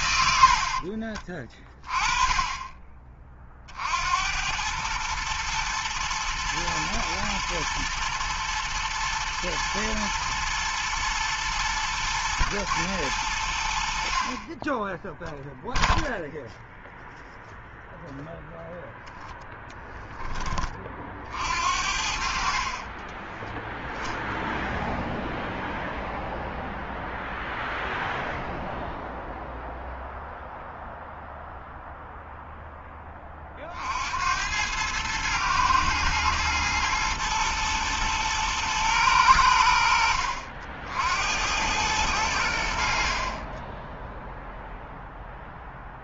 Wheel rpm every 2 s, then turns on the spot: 40, 20, 110, 110, 110, 110, 110, 0, 0, 10, 50, 30, 0, 0, 0, 0, 20, 110, 110, 100, 70, 50, 0.
0-2